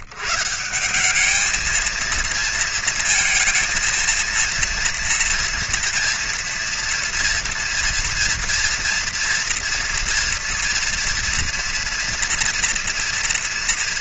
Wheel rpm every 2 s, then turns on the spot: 120, 230, 230, 230, 230, 230, 230.
none